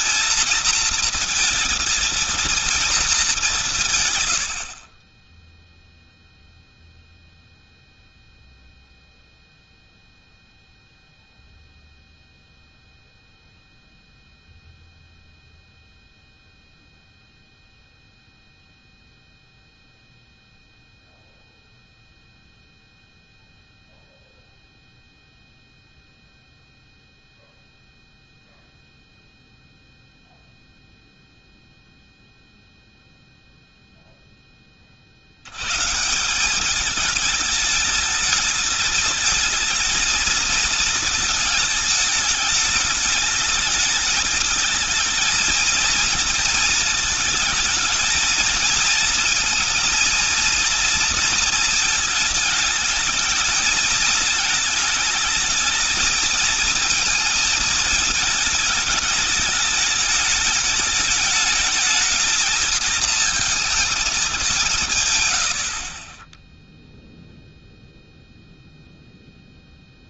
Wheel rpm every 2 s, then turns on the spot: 230, 230, 70, 0, 0, 0, 0, 0, 0, 0, 0, 0, 0, 0, 0, 0, 0, 20, 190, 220, 230, 210, 220, 220, 220, 230, 220, 220, 230, 220, 210, 220, 180, 10, 0.
none